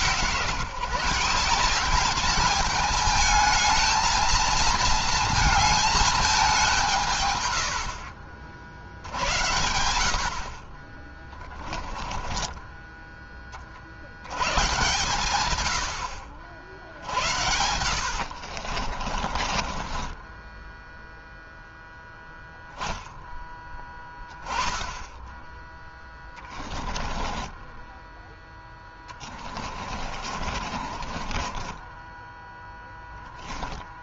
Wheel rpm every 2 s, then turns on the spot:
160, 220, 230, 170, 70, 30, 20, 140, 80, 50, 0, 0, 10, 20, 20, 30, 0.
18-20 26-32